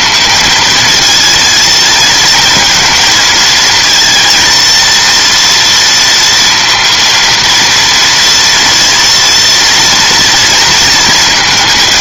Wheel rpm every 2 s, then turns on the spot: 220, 230, 230, 230, 230, 230.
none